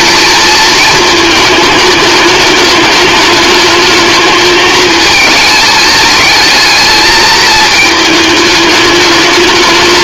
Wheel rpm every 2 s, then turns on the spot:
230, 210, 220, 220, 210.
none